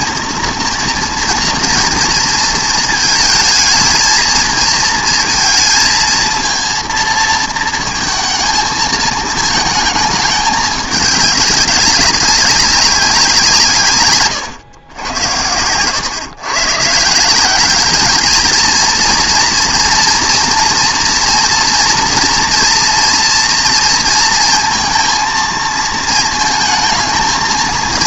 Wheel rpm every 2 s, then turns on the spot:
230, 220, 230, 230, 220, 210, 200, 100, 130, 230, 230, 240, 230, 220.
none